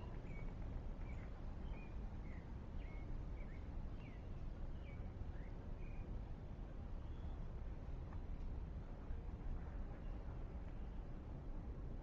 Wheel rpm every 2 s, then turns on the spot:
0, 0, 0, 0, 0, 0.
none